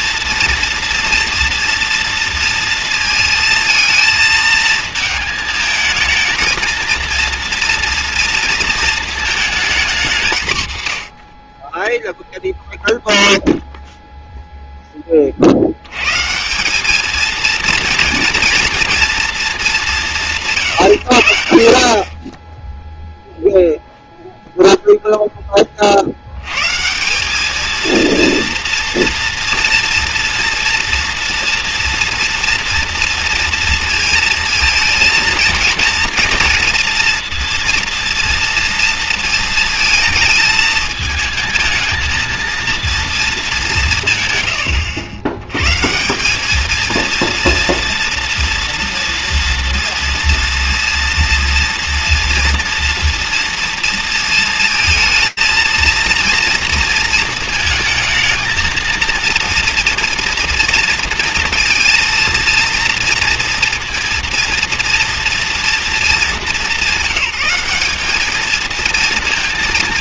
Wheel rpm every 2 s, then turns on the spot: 230, 230, 220, 230, 220, 100, 0, 20, 210, 230, 110, 0, 0, 170, 230, 230, 230, 220, 230, 230, 220, 230, 90, 230, 230, 230, 230, 230, 230, 230, 230, 230, 230, 190, 230.
none